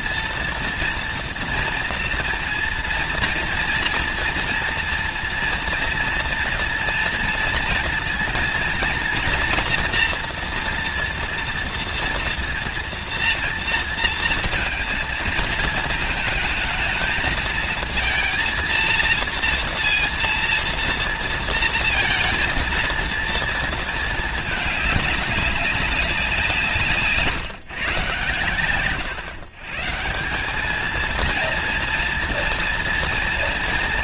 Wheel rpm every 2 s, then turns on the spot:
230, 230, 230, 230, 230, 230, 230, 230, 220, 230, 230, 230, 220, 170, 120, 200, 230.
none